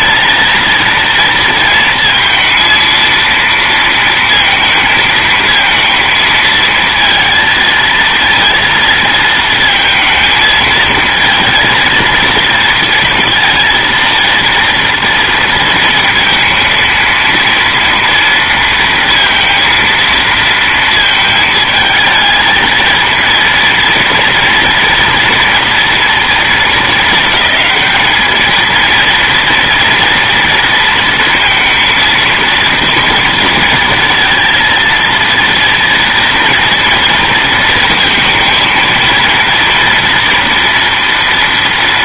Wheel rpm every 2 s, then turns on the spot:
230, 230, 220, 220, 230, 220, 230, 230, 230, 230, 230, 220, 240, 220, 220, 230, 230, 230, 230, 230, 230.
none